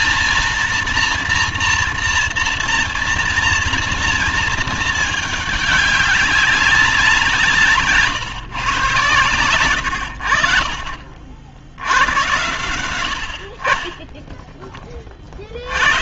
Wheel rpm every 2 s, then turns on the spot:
230, 230, 220, 180, 130, 60, 80, 30.
none